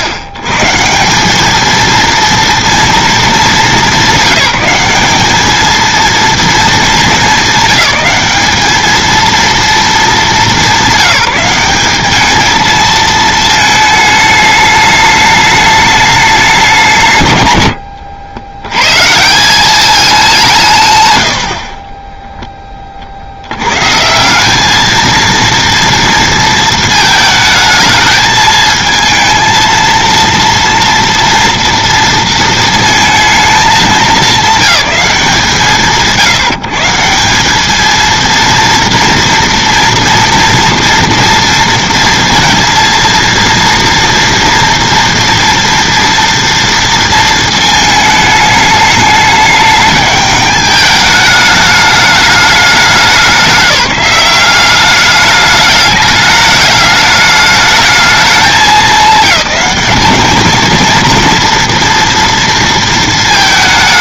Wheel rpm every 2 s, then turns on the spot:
140, 230, 200, 220, 210, 180, 220, 210, 210, 110, 150, 10, 200, 220, 220, 230, 230, 200, 160, 230, 230, 230, 230, 230, 210, 210, 200, 200, 210, 220, 220, 230.
none